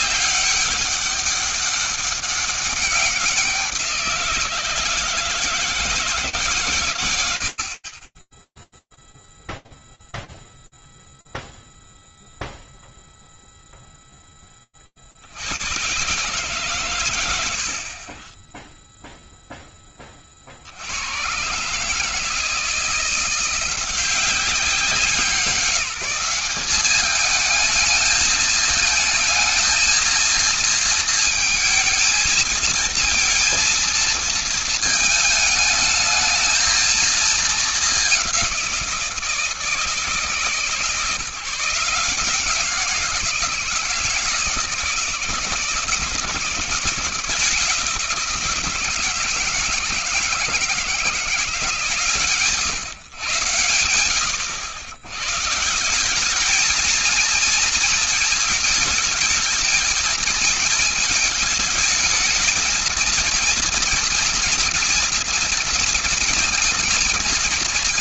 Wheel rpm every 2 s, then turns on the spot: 200, 190, 170, 100, 0, 0, 0, 20, 130, 10, 70, 160, 190, 200, 220, 230, 230, 220, 220, 180, 150, 170, 170, 170, 170, 170, 140, 110, 220, 220, 220, 230, 230, 230.
none